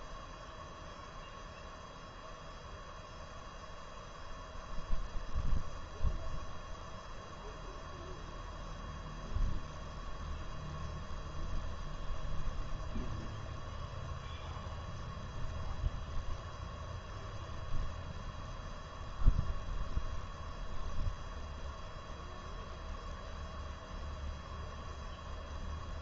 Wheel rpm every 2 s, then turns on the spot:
0, 0, 0, 0, 0, 0, 0, 0, 0, 0, 0, 0, 0.
none